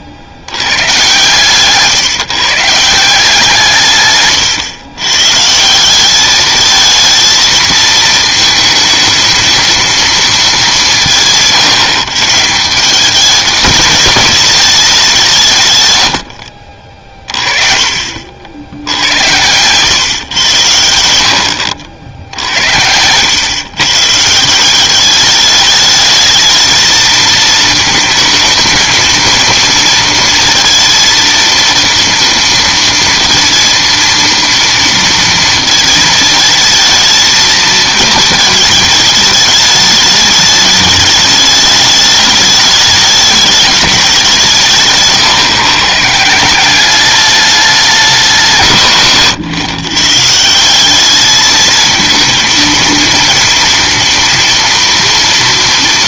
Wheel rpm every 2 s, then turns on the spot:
120, 170, 110, 220, 220, 190, 190, 200, 50, 80, 80, 80, 190, 220, 230, 230, 230, 230, 220, 220, 210, 210, 160, 190, 150, 190, 230, 230.
none